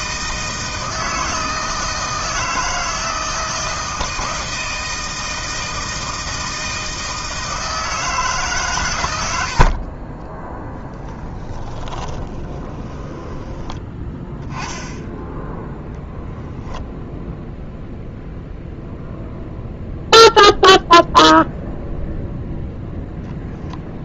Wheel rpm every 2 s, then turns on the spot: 160, 160, 160, 160, 130, 10, 20, 10, 10, 0, 0, 0.
10-14